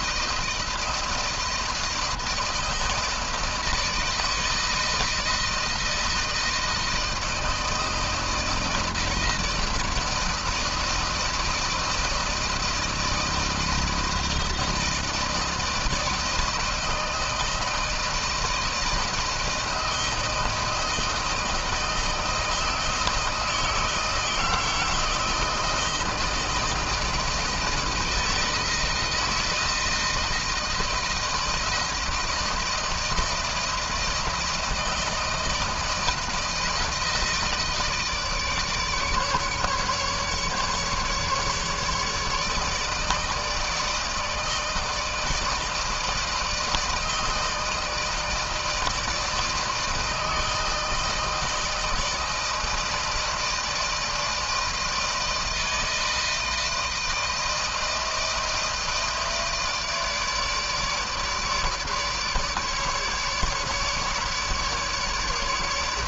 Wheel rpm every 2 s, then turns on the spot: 160, 160, 160, 160, 160, 160, 160, 160, 160, 160, 160, 160, 160, 160, 160, 160, 160, 160, 160, 150, 150, 150, 160, 160, 160, 160, 160, 160, 160, 160, 150, 150, 150.
none